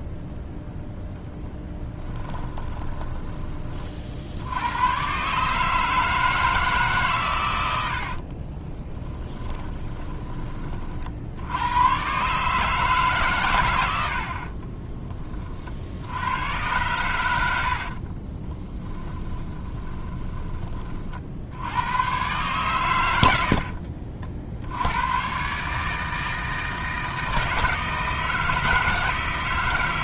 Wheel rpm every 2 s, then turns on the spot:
0, 10, 100, 150, 20, 40, 150, 30, 100, 20, 30, 110, 80, 160, 160.
2-4 8-10 14-16 18-20